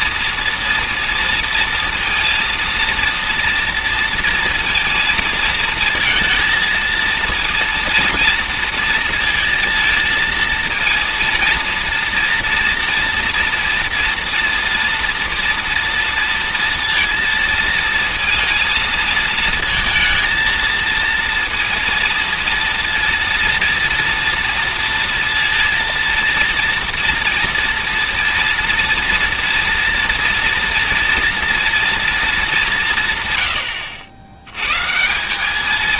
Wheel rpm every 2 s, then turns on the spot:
230, 230, 240, 230, 230, 230, 230, 230, 230, 230, 230, 230, 230, 230, 230, 230, 200, 110.
none